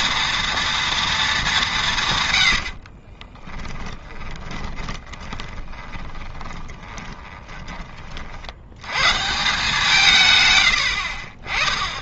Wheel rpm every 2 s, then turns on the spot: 230, 90, 20, 20, 90, 110.
2-8